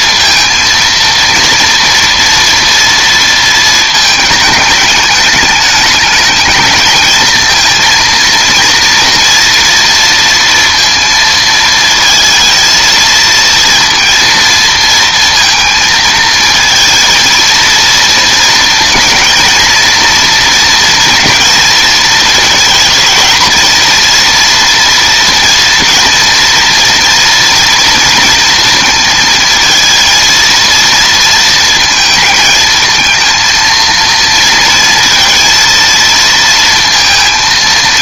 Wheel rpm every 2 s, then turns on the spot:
230, 230, 210, 220, 230, 230, 230, 230, 230, 230, 240, 230, 230, 230, 230, 230, 220, 230, 230.
none